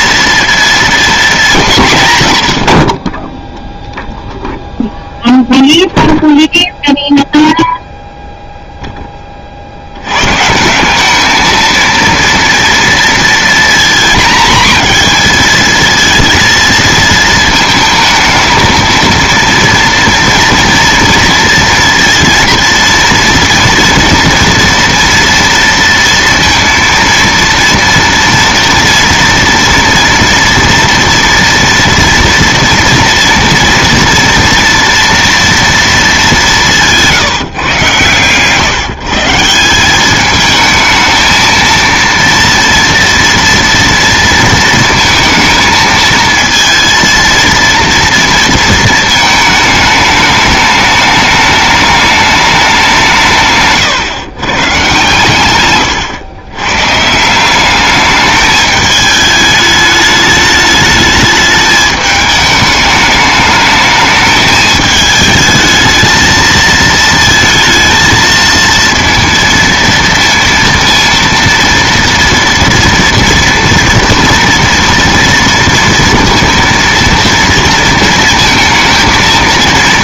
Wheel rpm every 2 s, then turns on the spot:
230, 90, 0, 0, 0, 160, 230, 230, 220, 220, 240, 230, 230, 230, 230, 230, 230, 230, 170, 120, 210, 230, 230, 230, 230, 210, 200, 130, 120, 210, 210, 210, 220, 220, 230, 230, 230, 240, 230, 230.
none